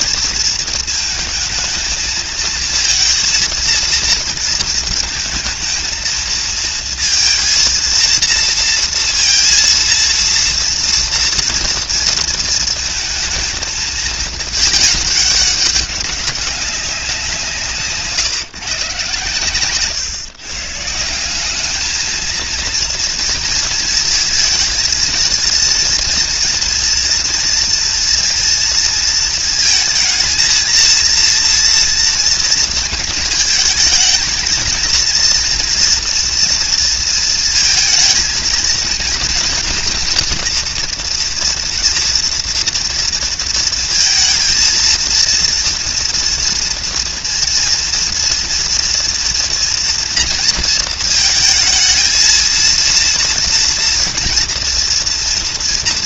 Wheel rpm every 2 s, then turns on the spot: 230, 230, 230, 230, 230, 230, 220, 220, 200, 140, 150, 230, 230, 240, 230, 230, 230, 230, 230, 230, 230, 230, 230, 230, 230, 230, 230, 230.
none